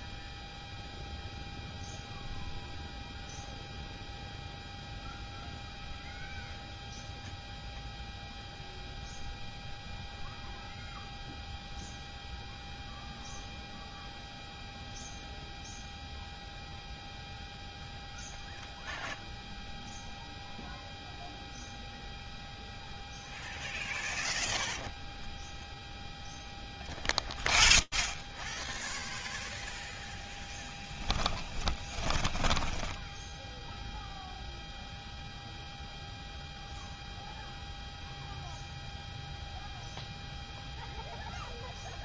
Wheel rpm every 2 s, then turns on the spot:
0, 0, 0, 0, 0, 0, 0, 0, 0, 0, 0, 0, 0, 0, 20, 0, 20, 0, 0, 0, 0.
32-34